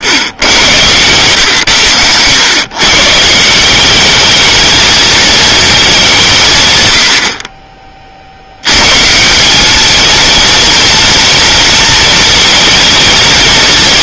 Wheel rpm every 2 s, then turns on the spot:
110, 120, 210, 130, 100, 230, 230.
none